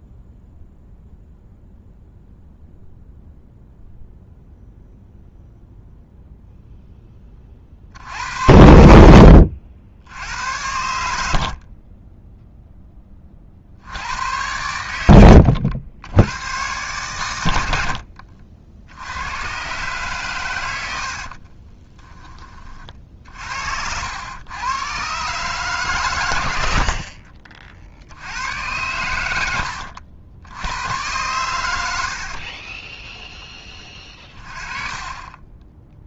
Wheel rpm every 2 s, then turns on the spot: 0, 0, 0, 10, 80, 80, 10, 100, 110, 80, 90, 40, 110, 60, 100, 100, 20, 30.
32-36